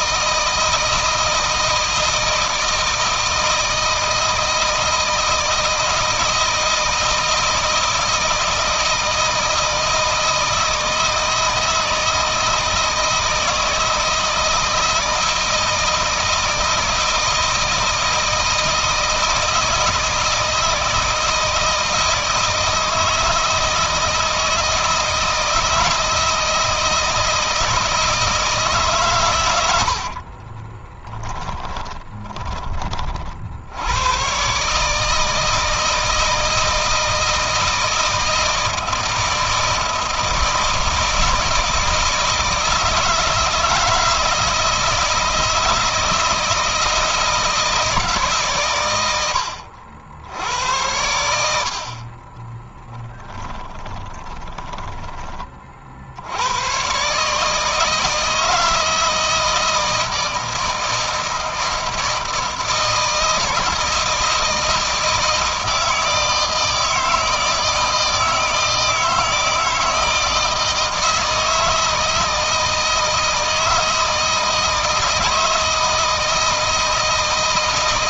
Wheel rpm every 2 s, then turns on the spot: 160, 160, 160, 160, 160, 160, 160, 160, 160, 160, 160, 160, 160, 160, 140, 20, 30, 140, 160, 160, 160, 160, 160, 160, 120, 90, 30, 20, 110, 160, 160, 160, 160, 160, 160, 160, 160, 160, 160.
30-32 52-56